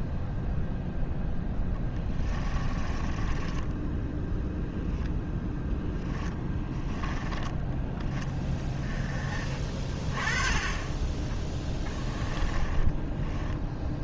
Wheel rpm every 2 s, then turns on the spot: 0, 20, 0, 10, 20, 30, 10.
2-4 6-8 10-14